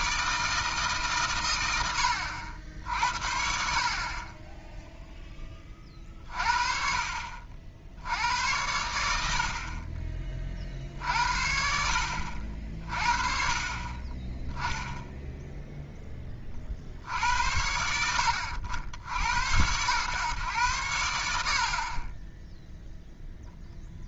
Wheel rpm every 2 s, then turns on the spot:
160, 80, 10, 50, 100, 50, 50, 10, 50, 80, 100, 0.
none